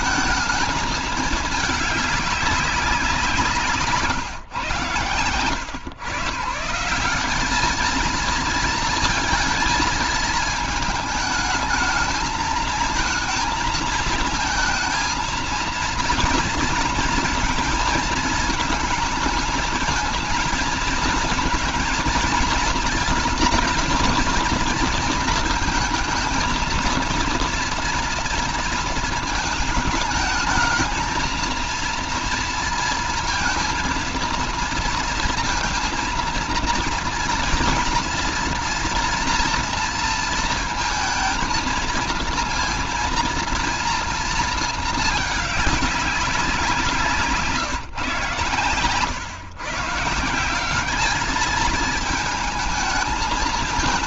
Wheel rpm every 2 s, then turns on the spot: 220, 190, 130, 170, 230, 220, 220, 230, 230, 220, 230, 230, 230, 230, 230, 220, 230, 230, 230, 230, 230, 230, 220, 180, 130, 190, 220.
none